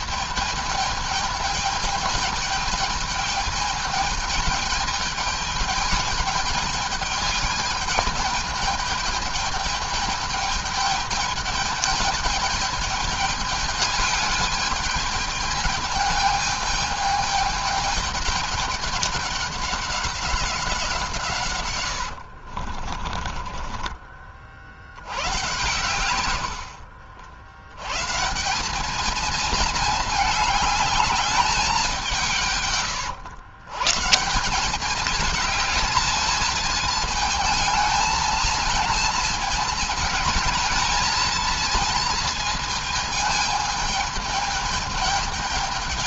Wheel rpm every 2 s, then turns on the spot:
210, 210, 210, 210, 210, 210, 210, 210, 210, 200, 170, 40, 80, 70, 200, 210, 120, 200, 220, 220, 220, 220, 210.
22-24 26-28